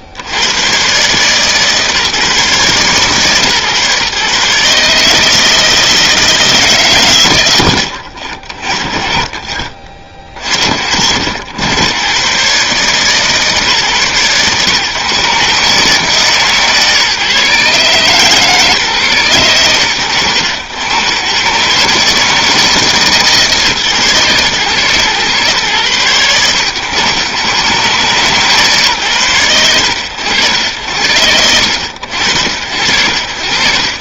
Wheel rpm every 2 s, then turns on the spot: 80, 140, 140, 160, 50, 60, 140, 120, 150, 140, 90, 150, 120, 100, 140, 80, 80.
none